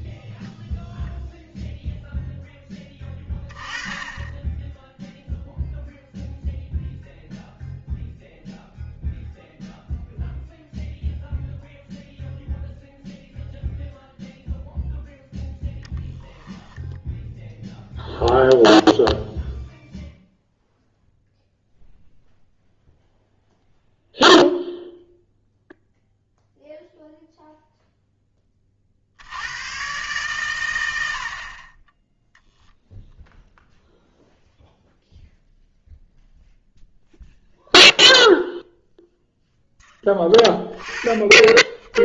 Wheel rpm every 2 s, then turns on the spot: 0, 10, 10, 0, 0, 0, 0, 0, 10, 0, 0, 0, 0, 0, 40, 110, 10, 0, 0, 0, 20.
16-18 32-34